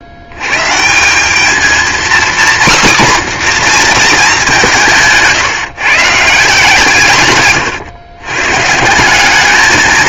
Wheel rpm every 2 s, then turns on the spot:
160, 270, 170, 150, 160.
none